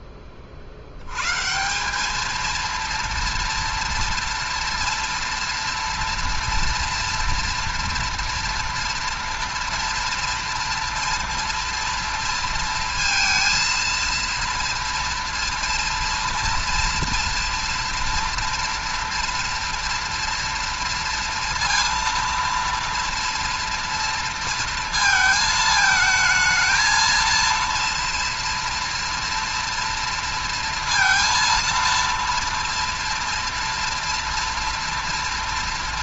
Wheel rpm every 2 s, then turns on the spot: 50, 230, 230, 230, 230, 230, 230, 230, 230, 230, 230, 230, 230, 220, 230, 230, 230, 230.
none